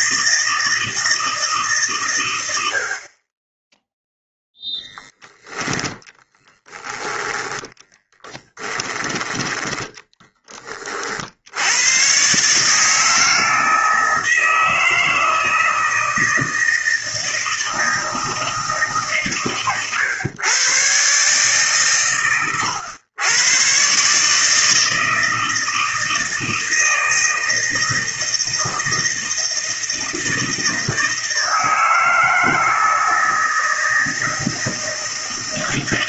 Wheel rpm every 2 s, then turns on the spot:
160, 70, 10, 10, 20, 40, 150, 160, 160, 150, 130, 110, 160, 160, 160, 160, 160, 160.
none